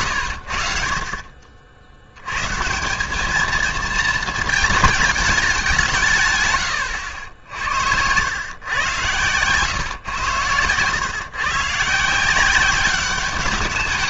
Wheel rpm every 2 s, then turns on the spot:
60, 150, 220, 110, 120, 110, 190.
none